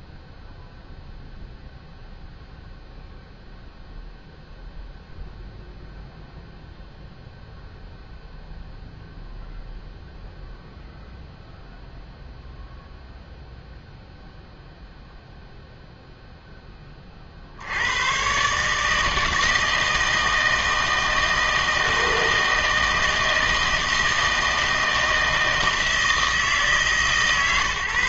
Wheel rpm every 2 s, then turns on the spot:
0, 0, 0, 0, 0, 0, 0, 0, 10, 150, 160, 160, 160, 160.
none